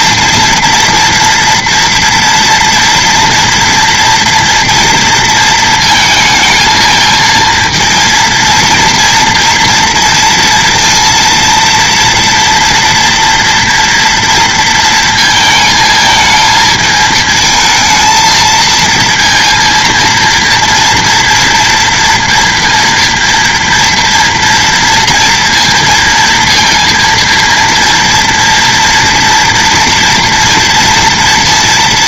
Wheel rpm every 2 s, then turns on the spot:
230, 230, 230, 220, 230, 230, 240, 230, 220, 230, 230, 230, 230, 230, 230, 230.
none